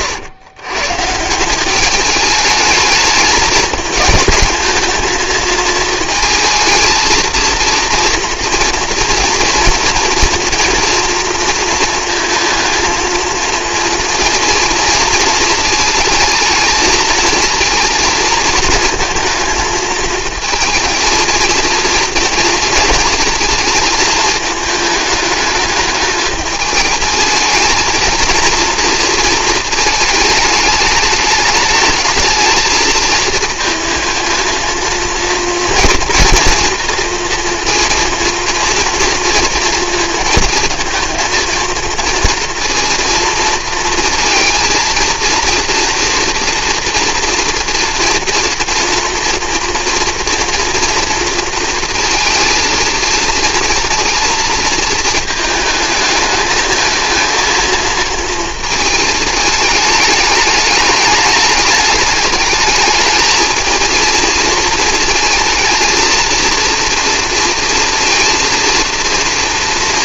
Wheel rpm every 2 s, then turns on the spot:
130, 210, 220, 220, 230, 230, 220, 230, 220, 230, 230, 220, 210, 220, 230, 220, 220, 230, 230, 230, 220, 230, 230, 240, 230, 230, 220, 230, 220, 220, 210, 210, 230, 230, 240.
none